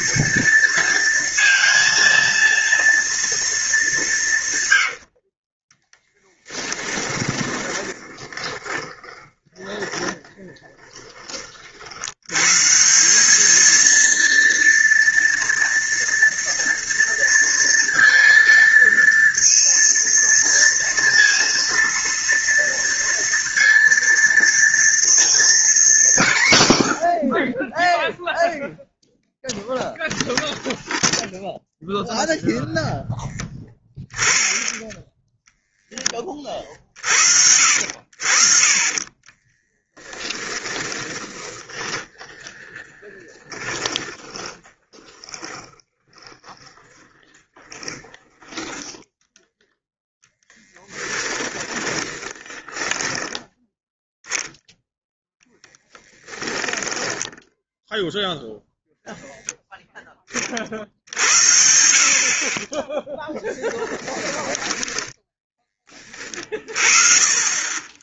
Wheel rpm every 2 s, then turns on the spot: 230, 230, 80, 10, 20, 20, 170, 230, 230, 230, 230, 230, 230, 100, 0, 0, 0, 10, 50, 40, 30, 10, 10, 20, 10, 10, 20, 0, 10, 0, 50, 10, 10, 40.
6-10 38-48 50-54 56-58 62-66